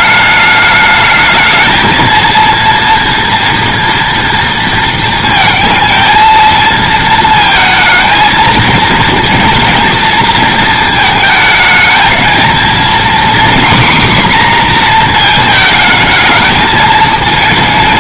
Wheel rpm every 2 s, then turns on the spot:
210, 230, 230, 220, 230, 230, 230, 250, 220.
none